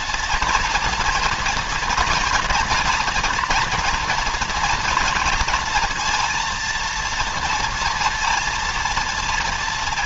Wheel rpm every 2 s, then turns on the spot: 230, 230, 240, 230, 230.
none